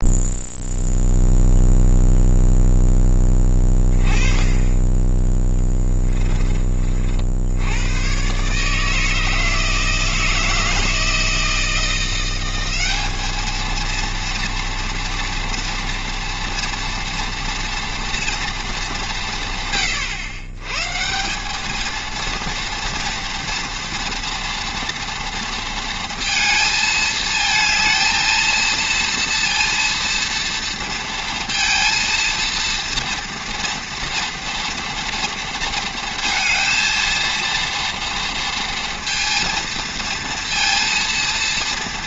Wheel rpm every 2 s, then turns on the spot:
0, 0, 10, 40, 150, 160, 200, 230, 230, 190, 140, 230, 230, 220, 230, 230, 230, 230, 230, 230, 230.
none